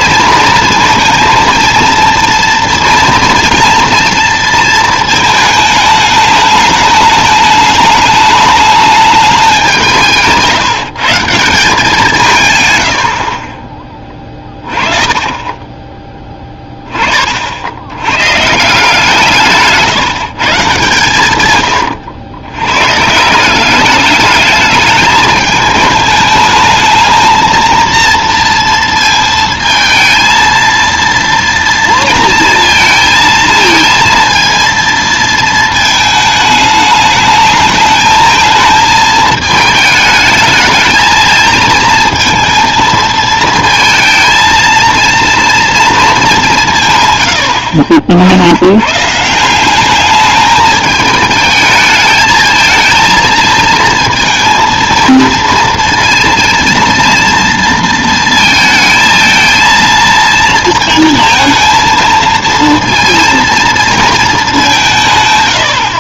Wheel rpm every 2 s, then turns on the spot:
230, 230, 230, 210, 210, 150, 130, 30, 10, 160, 150, 110, 210, 220, 230, 230, 230, 230, 210, 220, 220, 230, 230, 180, 100, 210, 220, 230, 230, 220, 230, 230, 190.
14-16